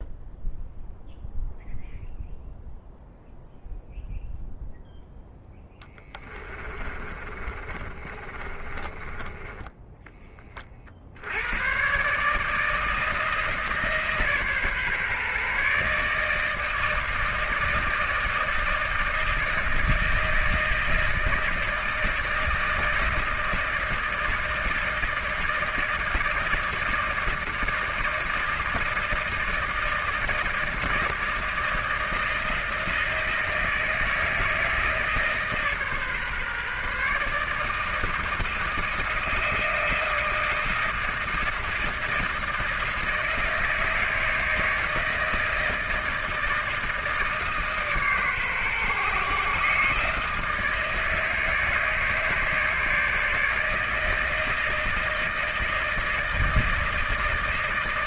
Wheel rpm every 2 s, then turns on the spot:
0, 0, 0, 20, 30, 30, 160, 140, 160, 160, 160, 160, 160, 160, 160, 160, 160, 160, 140, 160, 160, 160, 160, 160, 140, 160, 150, 160, 160.
6-10